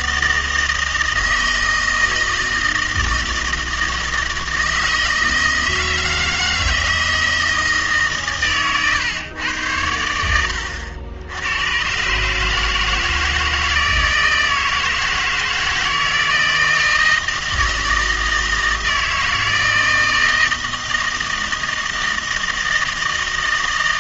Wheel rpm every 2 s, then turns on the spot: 160, 160, 160, 160, 130, 80, 150, 160, 160, 160, 160, 160.
8-10